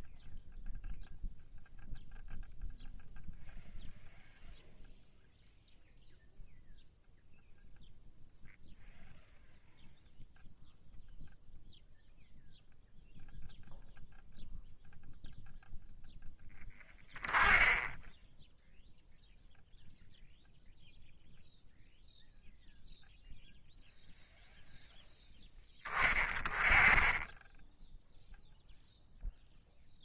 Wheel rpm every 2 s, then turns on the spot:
0, 0, 0, 0, 0, 0, 0, 0, 0, 0, 0, 0, 0, 20, 0.
none